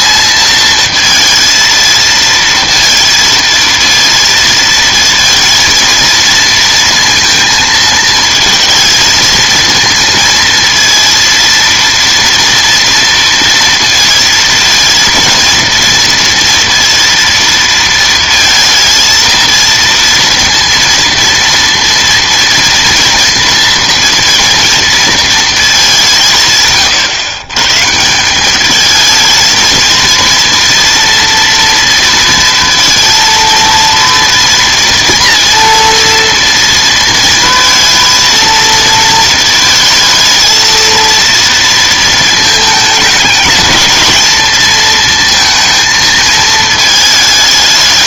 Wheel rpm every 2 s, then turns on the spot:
220, 230, 230, 230, 230, 230, 230, 230, 230, 230, 230, 230, 230, 130, 210, 230, 230, 230, 230, 230, 230, 220, 220, 220.
none